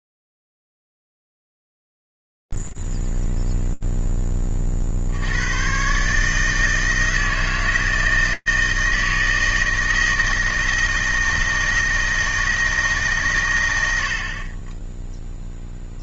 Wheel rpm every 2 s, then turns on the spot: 0, 0, 0, 120, 160, 160, 160, 80.
none